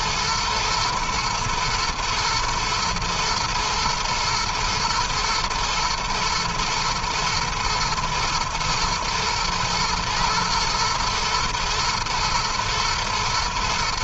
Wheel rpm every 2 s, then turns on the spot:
120, 120, 110, 120, 120, 110, 110.
none